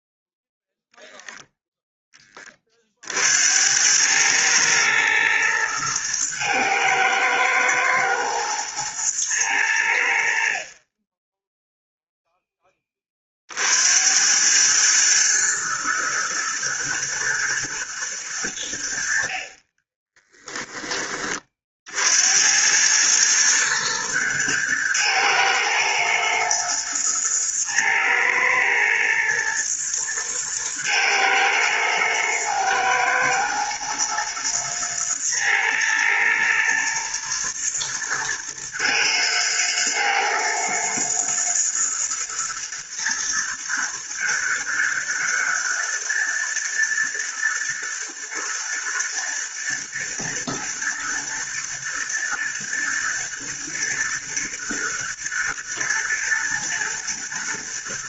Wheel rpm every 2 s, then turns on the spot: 0, 50, 110, 110, 110, 20, 20, 110, 110, 70, 20, 110, 110, 110, 110, 110, 110, 110, 110, 120, 120, 110, 110, 120, 110, 120, 110, 120, 120.
none